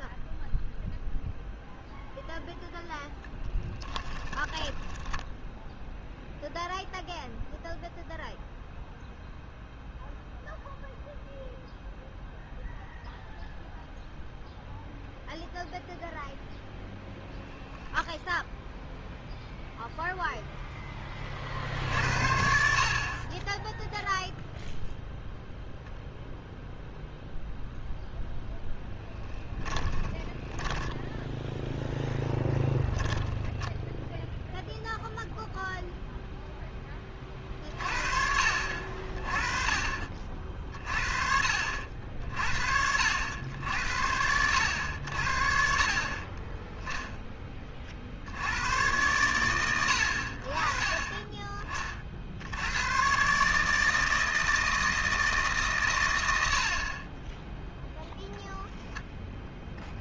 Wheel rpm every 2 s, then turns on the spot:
10, 0, 10, 0, 0, 0, 0, 0, 0, 0, 0, 60, 0, 0, 0, 10, 10, 0, 0, 50, 50, 60, 90, 20, 90, 40, 90, 160, 70, 0.
4-6 30-34